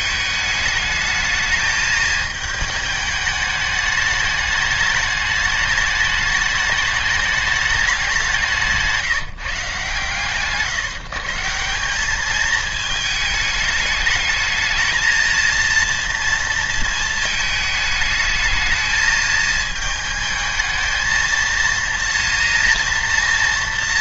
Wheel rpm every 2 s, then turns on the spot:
210, 220, 210, 210, 170, 140, 210, 220, 230, 220, 220, 230.
none